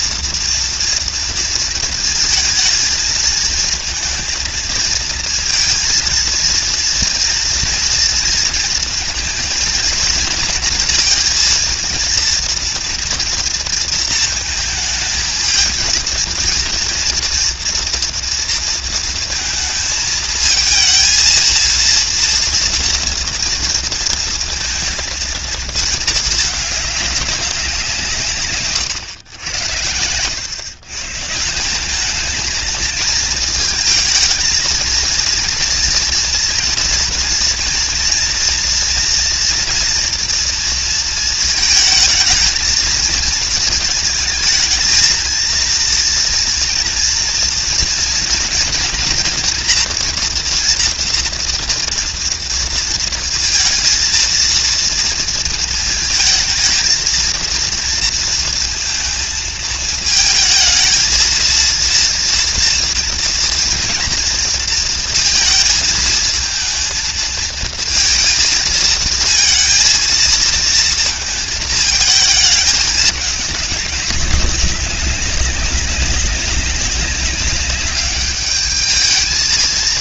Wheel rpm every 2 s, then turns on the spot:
230, 230, 230, 230, 230, 230, 230, 220, 230, 220, 230, 230, 230, 180, 90, 170, 220, 230, 230, 240, 220, 230, 230, 230, 230, 230, 230, 230, 220, 220, 230, 230, 230, 230, 230, 220, 210, 200, 200, 220.
none